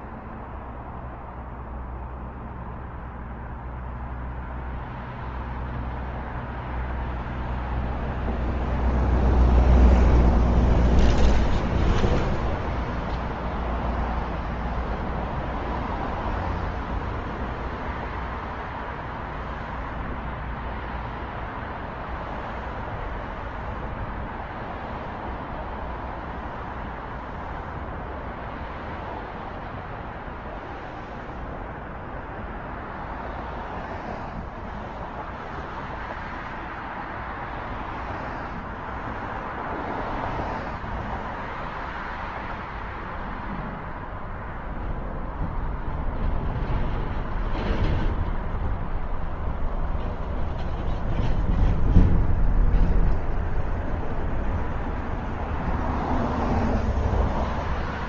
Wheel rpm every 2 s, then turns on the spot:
0, 0, 0, 0, 0, 0, 0, 0, 0, 0, 0, 0, 0, 0, 0, 0, 0, 0, 0, 0, 0, 0, 0, 0, 0, 0, 0, 0, 0.
none